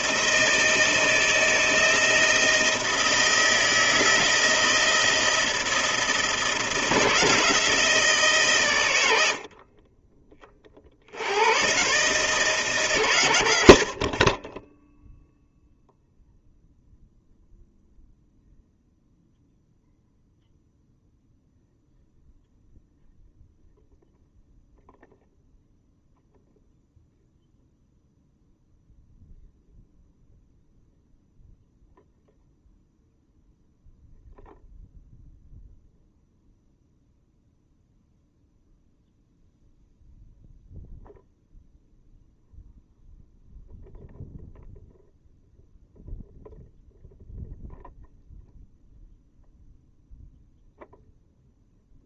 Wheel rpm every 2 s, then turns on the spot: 160, 160, 160, 170, 110, 40, 140, 10, 0, 0, 0, 0, 0, 0, 0, 0, 0, 0, 0, 0, 0, 0, 0, 0, 0, 0.
none